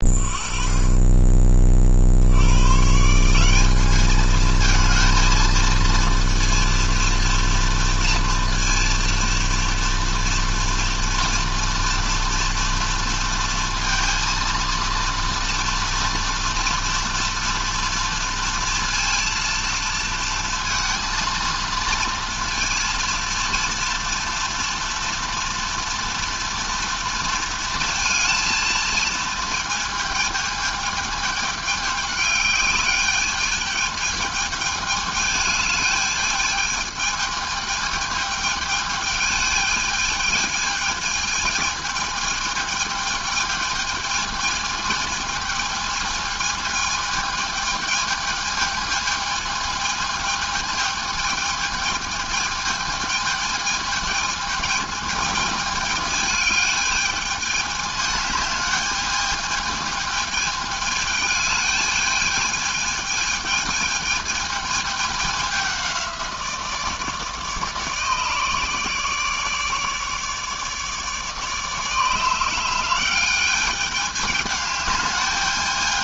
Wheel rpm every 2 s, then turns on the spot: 20, 150, 230, 240, 230, 230, 230, 230, 230, 230, 230, 230, 230, 230, 230, 220, 210, 210, 220, 220, 220, 220, 220, 220, 220, 220, 220, 220, 210, 210, 210, 220, 210, 160, 150, 150, 180, 210.
none